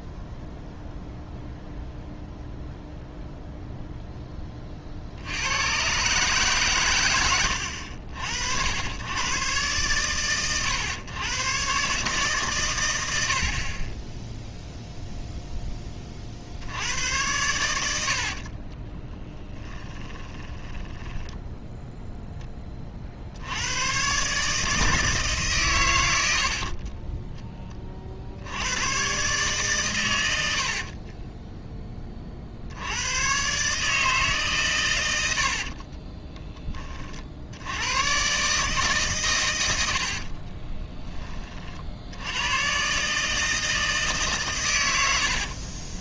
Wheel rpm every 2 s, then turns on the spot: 0, 0, 50, 120, 80, 110, 100, 0, 70, 30, 10, 30, 160, 40, 110, 50, 80, 110, 20, 140, 20, 130, 100.
18-22 26-28 30-32 40-42